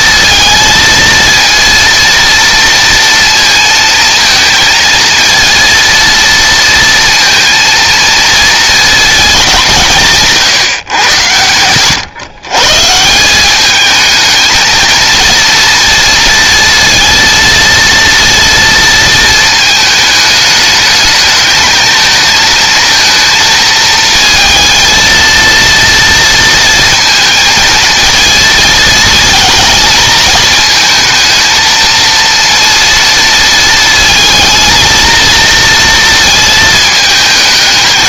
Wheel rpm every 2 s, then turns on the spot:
230, 230, 230, 230, 190, 100, 200, 230, 230, 220, 220, 230, 230, 220, 220, 220, 230, 230, 220.
none